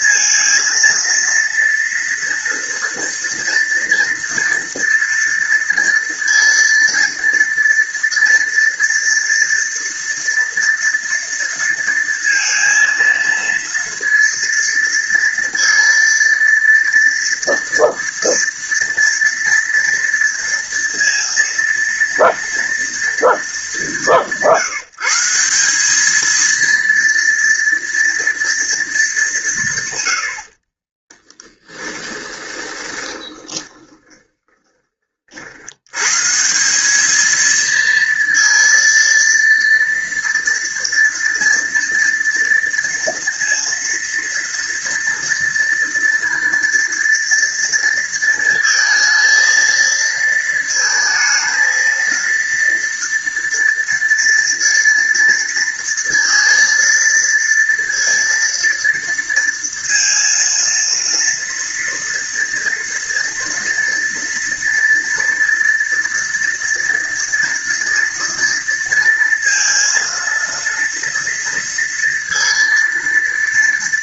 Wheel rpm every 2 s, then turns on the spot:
230, 230, 230, 230, 230, 230, 230, 230, 230, 230, 230, 230, 170, 230, 220, 30, 20, 30, 200, 230, 230, 230, 230, 230, 230, 220, 230, 230, 230, 230, 230, 230, 230, 230, 230, 230, 230.
30-34